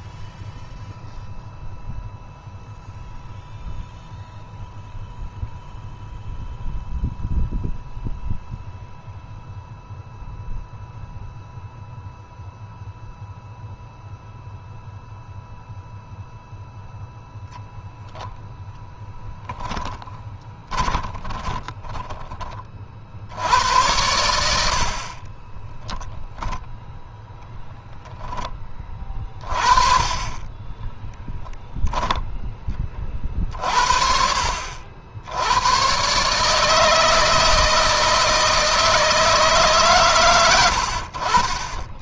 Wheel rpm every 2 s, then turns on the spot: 0, 0, 0, 0, 0, 0, 0, 0, 0, 0, 20, 40, 60, 0, 20, 20, 20, 60, 150, 160, 70.
20-22 30-32